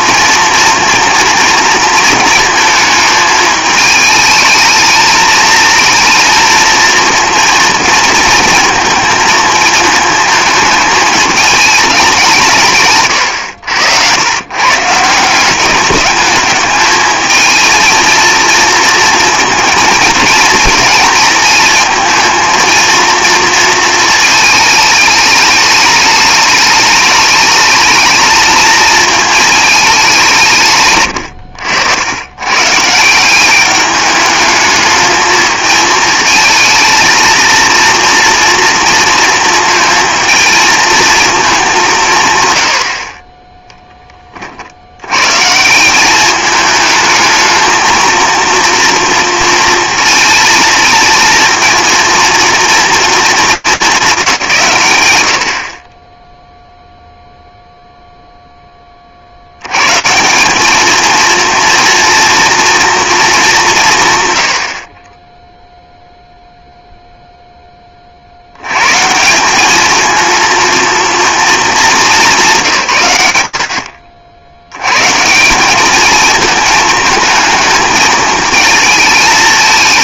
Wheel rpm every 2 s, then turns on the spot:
230, 220, 220, 230, 230, 220, 170, 120, 210, 220, 230, 230, 220, 210, 220, 150, 140, 220, 220, 230, 220, 110, 50, 210, 230, 220, 230, 180, 0, 20, 210, 240, 50, 0, 160, 220, 100, 170, 220, 220.
none